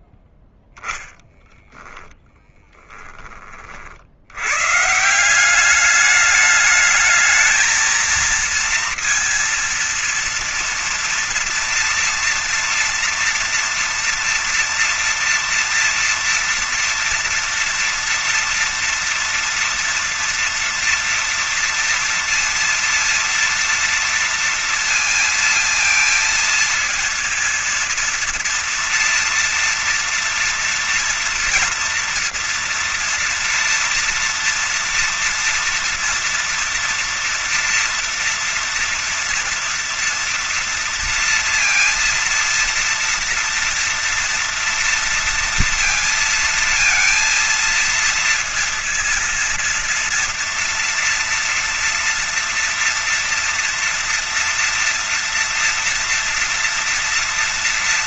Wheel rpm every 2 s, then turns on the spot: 20, 10, 120, 210, 230, 230, 240, 240, 230, 230, 230, 230, 230, 230, 230, 230, 240, 230, 230, 240, 240, 230, 230, 230, 230, 230, 230, 230, 230.
none